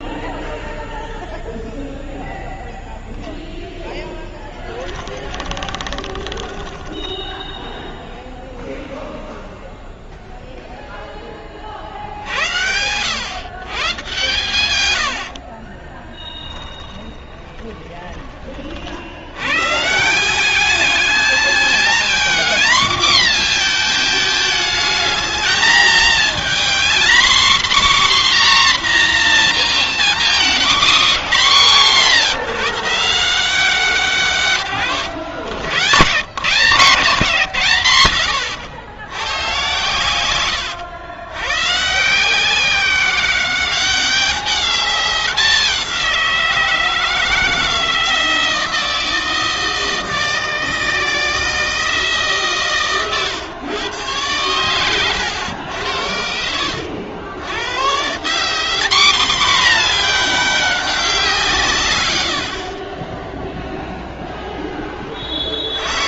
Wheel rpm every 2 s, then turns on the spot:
0, 0, 0, 20, 20, 0, 10, 110, 70, 20, 80, 210, 240, 220, 240, 250, 210, 160, 100, 180, 110, 110, 190, 190, 160, 160, 160, 120, 100, 90, 210, 180, 10.
6-10 16-20 36-38